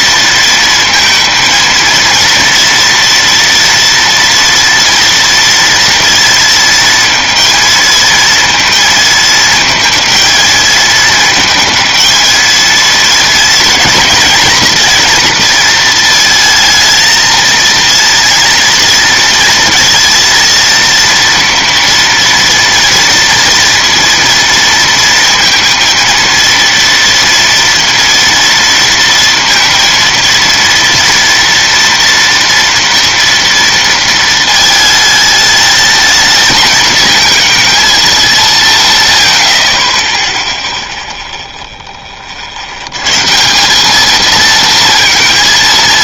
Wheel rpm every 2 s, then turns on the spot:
230, 230, 230, 220, 220, 220, 230, 230, 230, 230, 230, 230, 230, 230, 230, 230, 230, 210, 230, 70, 0, 160, 230.
none